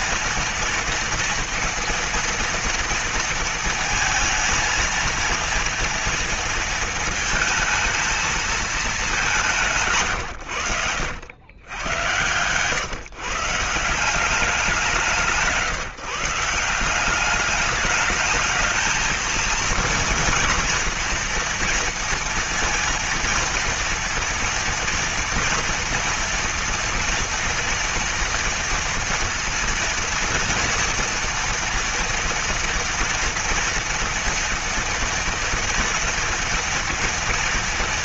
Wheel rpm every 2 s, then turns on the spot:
230, 230, 230, 230, 220, 120, 120, 190, 160, 210, 230, 230, 230, 230, 230, 240, 230, 230, 230.
10-12